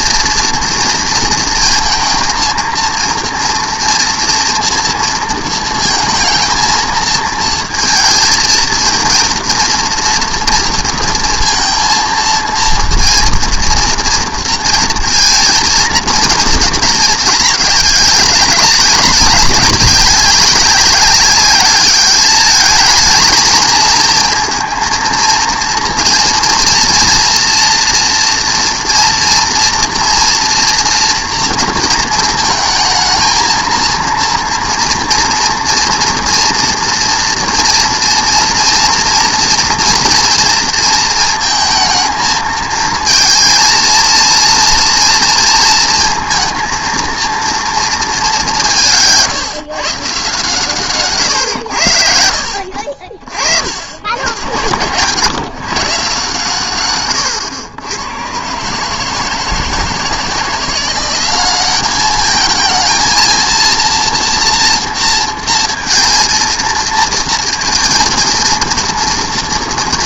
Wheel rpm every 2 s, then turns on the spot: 240, 230, 230, 230, 230, 230, 230, 230, 220, 200, 200, 220, 230, 230, 240, 230, 220, 230, 230, 230, 230, 220, 230, 230, 170, 140, 60, 100, 130, 150, 170, 220, 230, 230, 230.
none